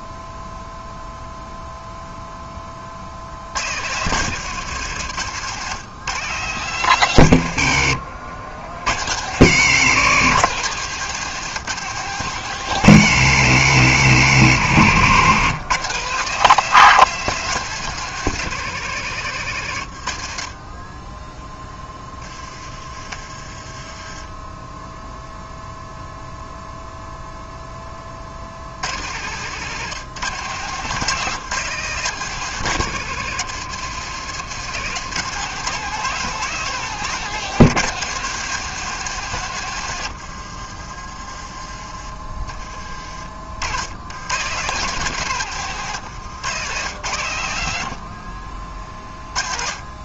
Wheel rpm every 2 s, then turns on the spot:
0, 50, 120, 110, 90, 150, 120, 110, 160, 130, 10, 20, 0, 0, 90, 140, 150, 160, 160, 150, 30, 40, 130, 80, 30.
40-44